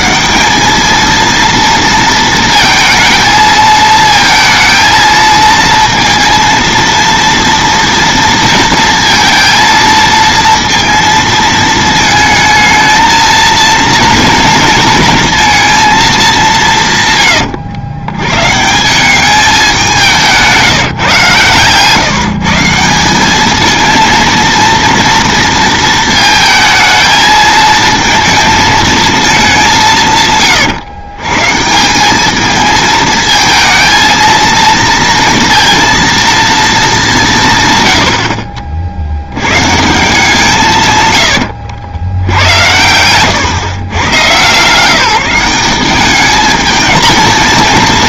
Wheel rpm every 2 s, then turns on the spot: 200, 230, 230, 230, 230, 230, 220, 230, 170, 150, 160, 170, 230, 220, 220, 120, 210, 230, 200, 70, 130, 100, 160, 220.
none